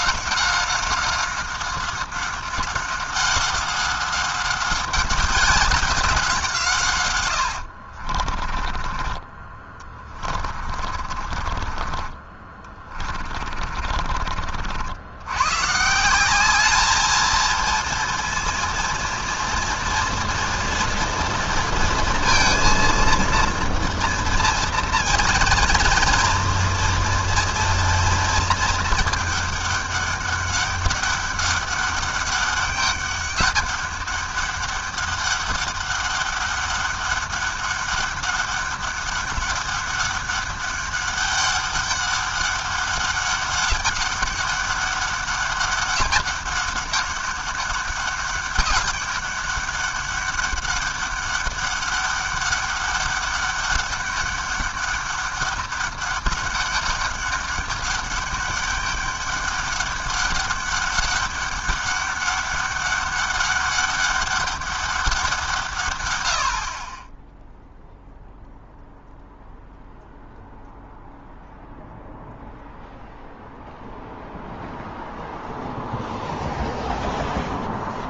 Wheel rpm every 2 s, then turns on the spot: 190, 190, 200, 140, 30, 40, 30, 60, 210, 230, 230, 230, 240, 230, 220, 200, 200, 200, 200, 200, 200, 200, 200, 200, 200, 200, 200, 200, 200, 200, 200, 200, 200, 40, 0, 0, 0, 0, 0.
8-14